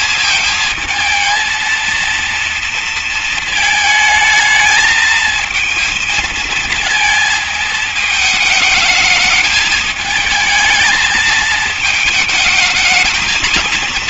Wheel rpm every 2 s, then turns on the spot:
220, 230, 220, 230, 220, 220, 220.
none